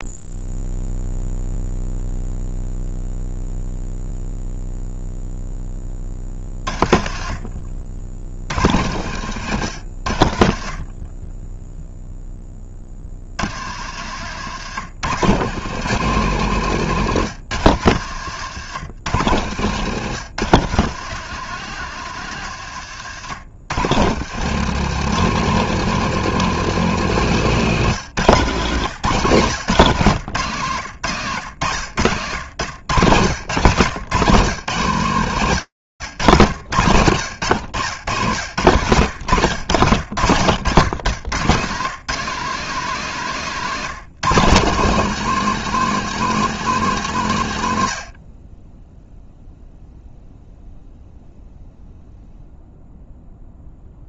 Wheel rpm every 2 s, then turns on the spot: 0, 0, 0, 40, 90, 30, 50, 120, 130, 110, 120, 100, 140, 160, 170, 140, 110, 130, 110, 120, 120, 190, 200, 160, 0, 0, 0.
16-18